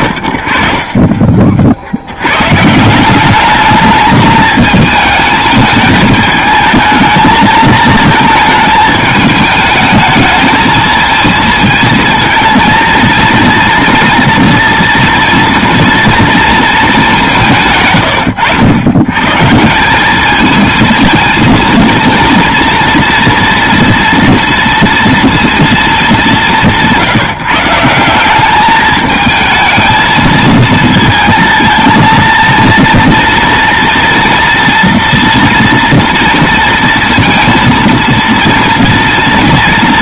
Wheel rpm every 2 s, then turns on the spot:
40, 150, 220, 220, 220, 220, 230, 230, 220, 100, 230, 230, 230, 170, 210, 230, 230, 240, 230, 230.
none